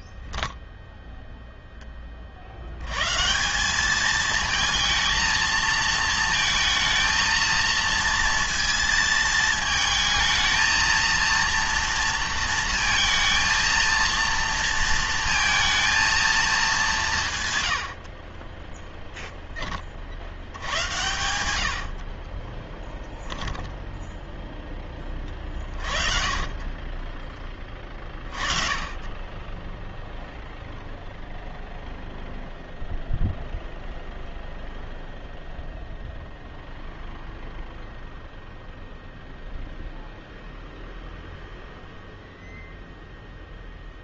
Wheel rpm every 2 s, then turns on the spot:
0, 90, 220, 220, 230, 230, 230, 230, 200, 10, 110, 10, 10, 20, 30, 0, 0, 0, 0, 0, 0, 0.
22-24